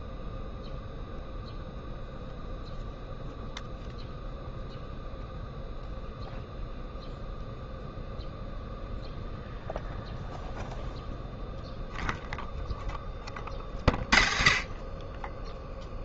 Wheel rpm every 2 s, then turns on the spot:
0, 0, 0, 0, 0, 0, 0, 30.
none